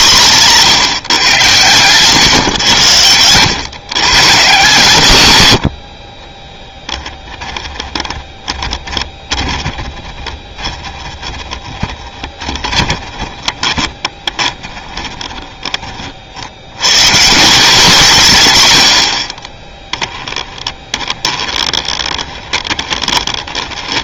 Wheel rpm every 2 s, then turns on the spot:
150, 110, 130, 10, 20, 20, 20, 20, 100, 120, 20, 20.
8-16 20-24